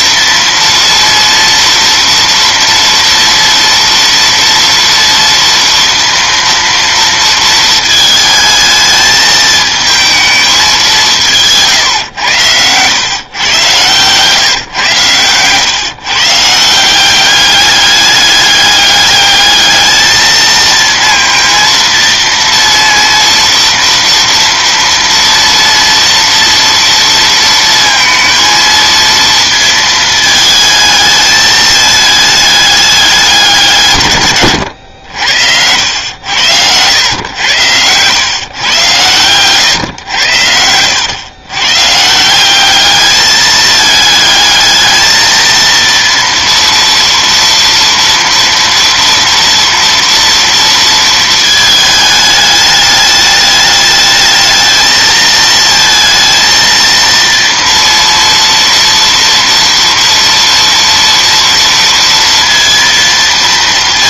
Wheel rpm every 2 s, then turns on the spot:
230, 230, 240, 230, 220, 190, 120, 120, 170, 210, 230, 230, 230, 230, 230, 220, 210, 100, 100, 120, 90, 200, 220, 230, 230, 230, 210, 220, 230, 230, 230, 230.
none